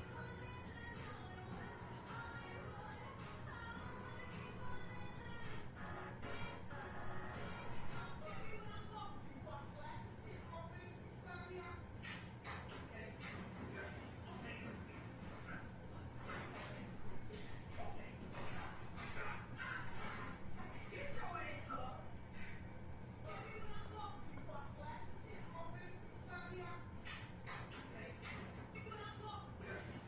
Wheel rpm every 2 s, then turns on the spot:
0, 0, 0, 0, 0, 0, 0, 0, 0, 0, 0, 0, 0, 0, 0.
none